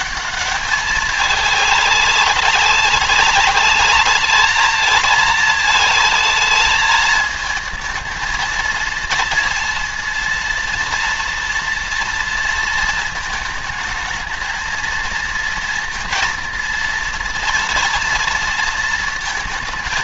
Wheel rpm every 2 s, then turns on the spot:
210, 200, 220, 220, 230, 230, 230, 230, 230, 230.
none